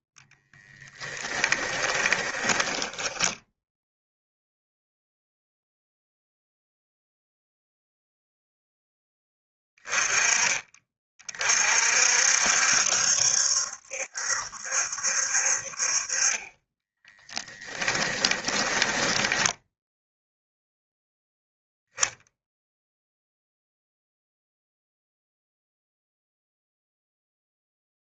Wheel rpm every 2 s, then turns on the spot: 10, 10, 0, 0, 10, 40, 70, 70, 10, 20, 0, 0, 0, 0.
0-4 18-20